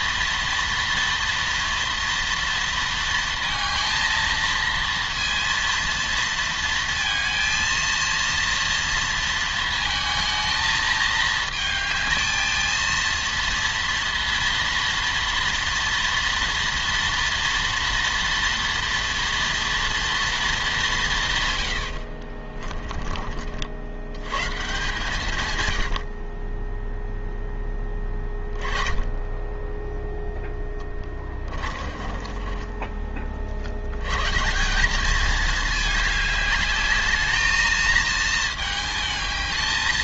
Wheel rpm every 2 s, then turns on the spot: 230, 230, 230, 230, 230, 220, 230, 230, 230, 230, 190, 40, 140, 0, 10, 20, 20, 200, 210, 220.
30-34